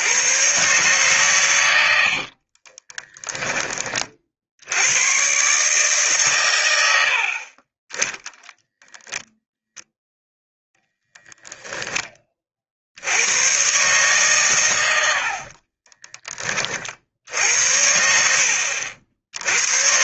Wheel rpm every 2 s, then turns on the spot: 130, 20, 100, 110, 10, 0, 60, 110, 40, 70.
2-4